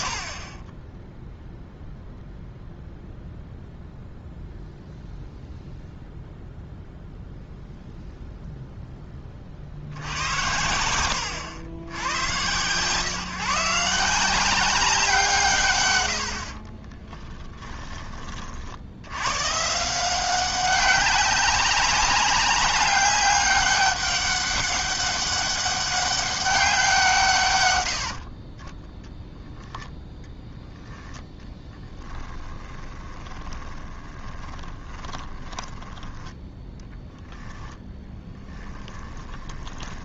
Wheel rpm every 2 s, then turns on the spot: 10, 0, 0, 0, 0, 90, 130, 190, 30, 70, 190, 190, 200, 180, 20, 0, 20, 20, 10, 20.
16-18 32-36 38-40